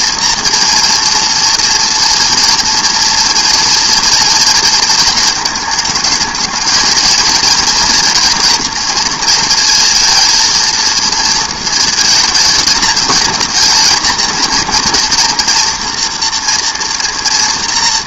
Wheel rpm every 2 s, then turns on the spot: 230, 230, 230, 220, 240, 230, 220, 230, 240.
none